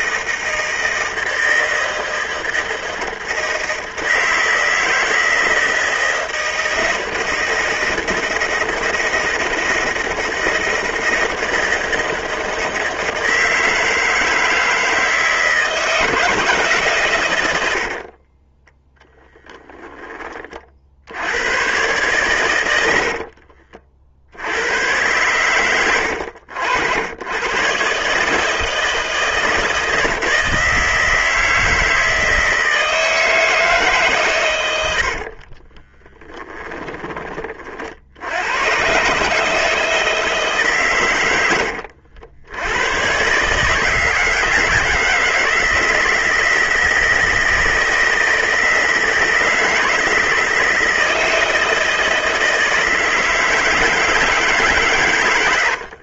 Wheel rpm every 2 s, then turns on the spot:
160, 160, 160, 160, 160, 160, 160, 160, 140, 10, 50, 90, 90, 80, 160, 160, 160, 80, 10, 110, 140, 100, 160, 160, 160, 160, 160, 140.
18-20 34-36